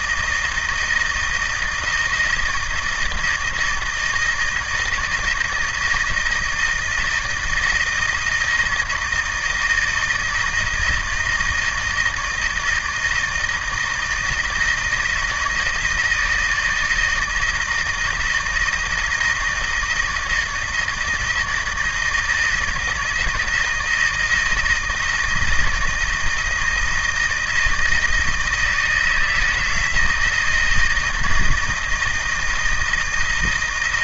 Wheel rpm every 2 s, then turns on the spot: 160, 160, 160, 160, 160, 160, 160, 160, 160, 160, 160, 160, 160, 160, 160, 160, 170.
none